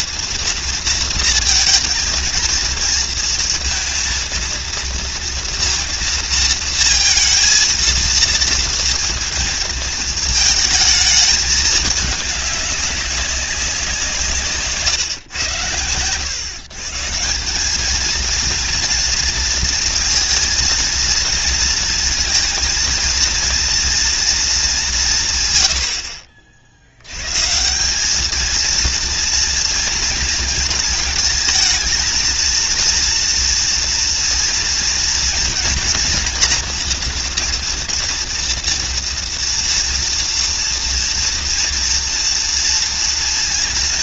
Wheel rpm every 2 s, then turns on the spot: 230, 230, 230, 230, 230, 220, 210, 150, 130, 230, 230, 230, 220, 60, 220, 230, 220, 230, 230, 230, 230, 230.
none